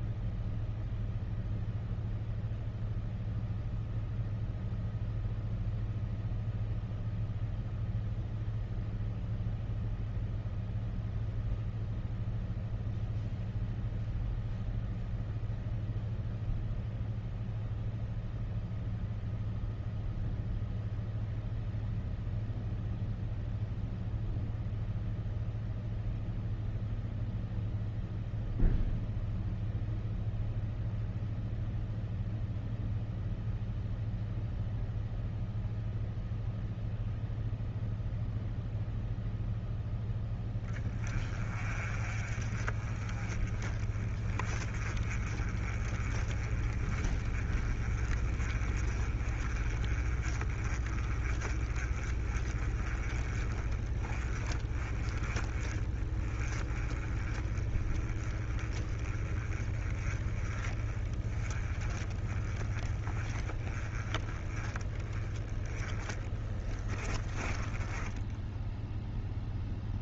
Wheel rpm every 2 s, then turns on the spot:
0, 0, 0, 0, 0, 0, 0, 0, 0, 0, 0, 0, 0, 0, 0, 0, 0, 0, 0, 0, 20, 30, 30, 30, 30, 30, 30, 20, 20, 20, 20, 20, 10, 20, 0.
66-68